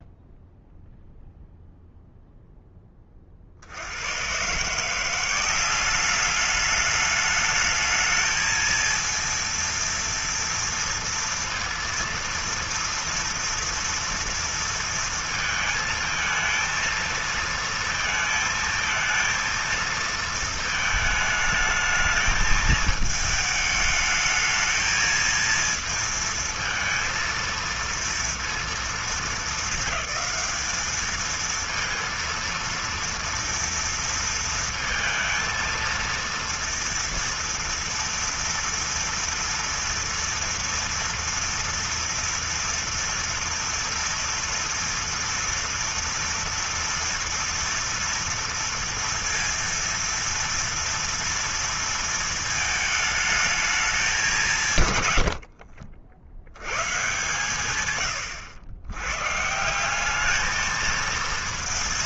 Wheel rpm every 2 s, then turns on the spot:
0, 30, 170, 210, 230, 230, 230, 230, 230, 220, 220, 220, 220, 230, 210, 210, 230, 230, 230, 230, 230, 230, 230, 230, 230, 230, 220, 130, 100, 100, 220.
none